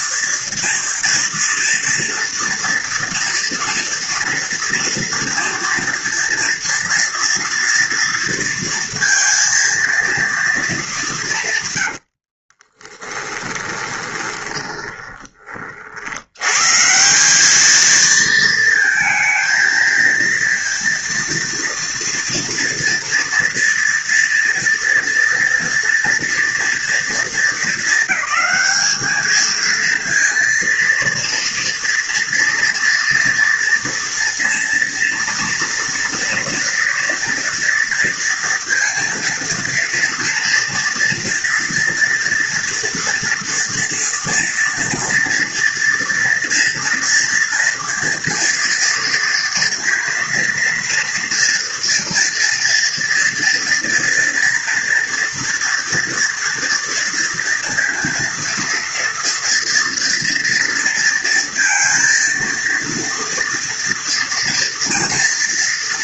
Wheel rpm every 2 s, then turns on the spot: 230, 240, 230, 230, 230, 220, 30, 20, 110, 220, 230, 230, 240, 230, 220, 230, 230, 230, 230, 230, 230, 230, 240, 230, 230, 240, 230, 230, 230, 230, 230, 230, 230.
12-16